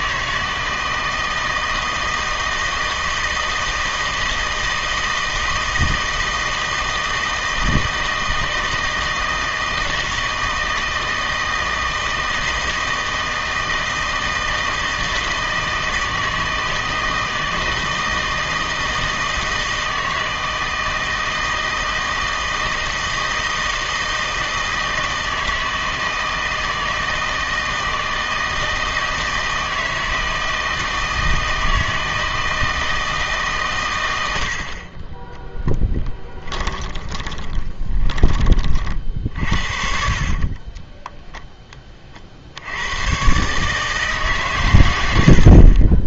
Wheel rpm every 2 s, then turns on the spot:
160, 160, 160, 160, 160, 160, 160, 160, 160, 160, 160, 160, 160, 160, 160, 160, 160, 60, 20, 40, 10, 80, 120.
36-38 40-42